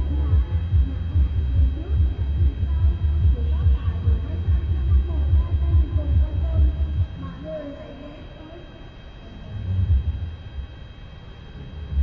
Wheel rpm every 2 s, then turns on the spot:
0, 0, 0, 0, 0, 0.
none